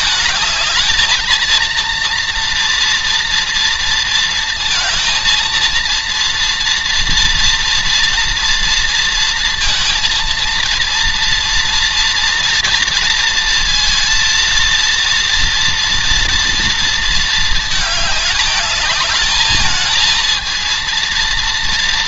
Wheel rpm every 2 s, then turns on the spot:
220, 230, 230, 230, 230, 230, 230, 230, 230, 210, 220.
none